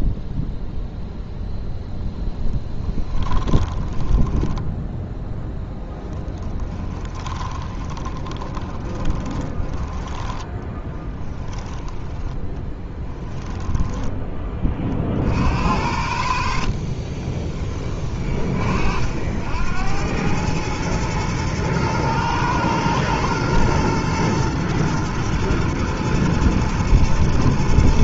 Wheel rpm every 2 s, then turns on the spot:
0, 10, 10, 30, 20, 10, 10, 30, 50, 50, 110, 110, 120, 110.
2-14 16-18